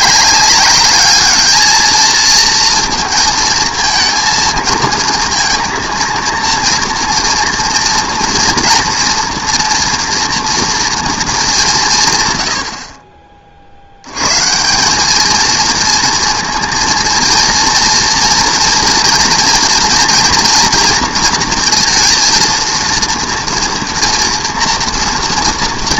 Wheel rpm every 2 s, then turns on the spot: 230, 230, 230, 230, 230, 130, 100, 230, 230, 230, 230, 240, 230.
none